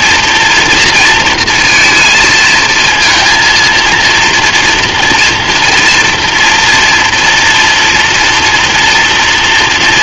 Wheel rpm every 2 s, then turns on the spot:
230, 220, 240, 230, 230.
none